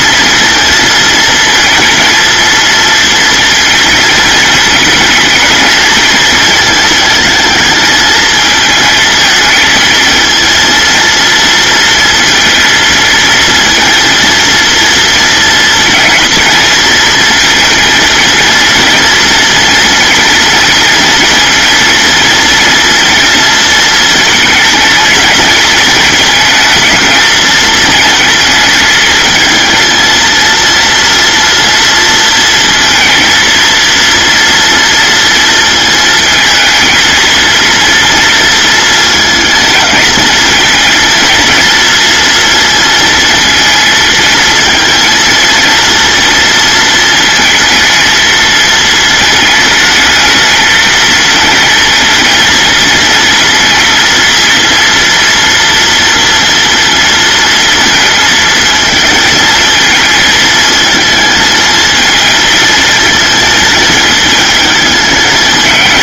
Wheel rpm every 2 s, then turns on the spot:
230, 230, 220, 220, 220, 230, 230, 230, 230, 230, 230, 230, 230, 220, 220, 230, 230, 230, 220, 230, 220, 230, 230, 230, 220, 220, 220, 230, 230, 230, 220, 220, 210.
none